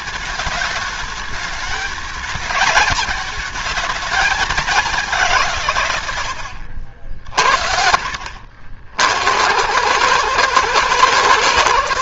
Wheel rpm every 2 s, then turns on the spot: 210, 220, 200, 60, 60, 110.
none